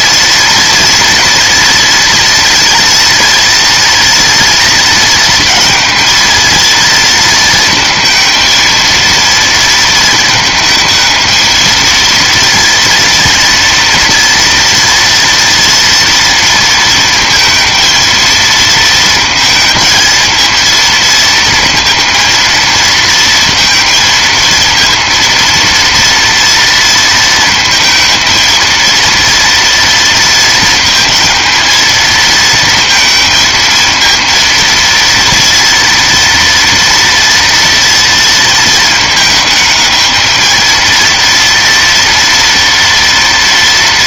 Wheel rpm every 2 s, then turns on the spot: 230, 230, 230, 230, 230, 220, 230, 230, 230, 220, 230, 220, 230, 230, 230, 220, 220, 230, 240, 220, 230, 230.
none